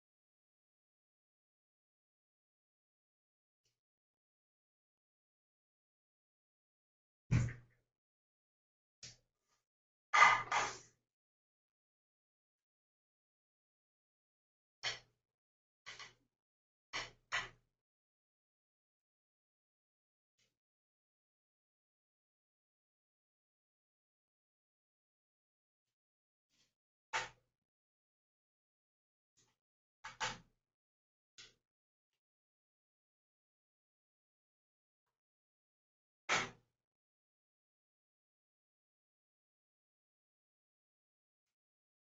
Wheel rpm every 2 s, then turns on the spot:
0, 0, 0, 0, 0, 0, 0, 0, 0, 0, 0, 0, 0, 0, 0, 0, 0, 0, 0, 0, 0.
none